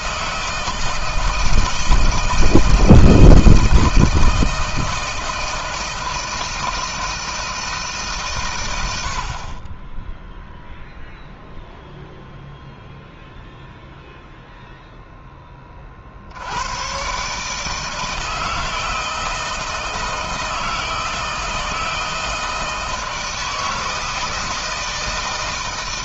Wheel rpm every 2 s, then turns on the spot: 160, 160, 160, 160, 110, 0, 0, 0, 100, 160, 160, 160, 160.
none